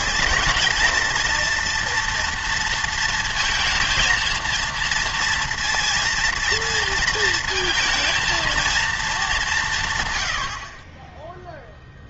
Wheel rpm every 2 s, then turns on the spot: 230, 230, 230, 230, 230, 70.
none